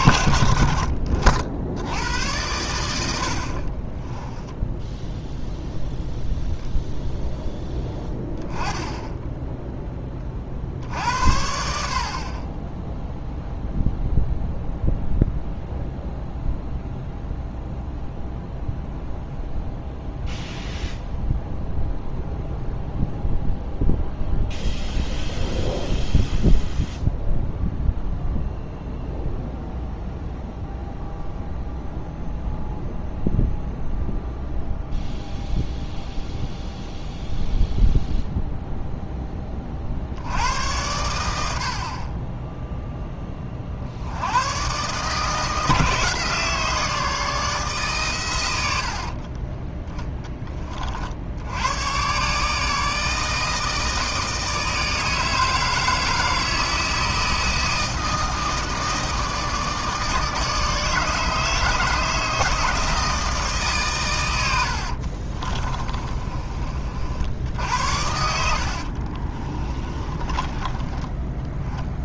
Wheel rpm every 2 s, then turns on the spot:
60, 90, 10, 10, 10, 70, 10, 0, 0, 0, 0, 0, 0, 0, 0, 0, 0, 0, 0, 0, 90, 10, 150, 160, 70, 40, 160, 160, 160, 160, 150, 160, 50, 50, 50, 20.
64-66 68-70